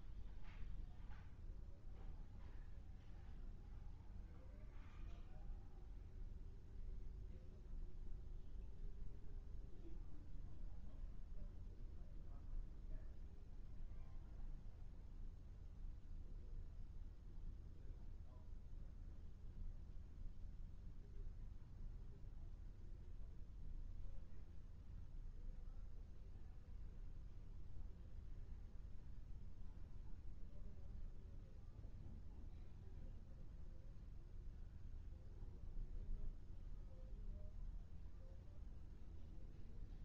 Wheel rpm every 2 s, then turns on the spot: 0, 0, 0, 0, 0, 0, 0, 0, 0, 0, 0, 0, 0, 0, 0, 0, 0, 0, 0, 0.
none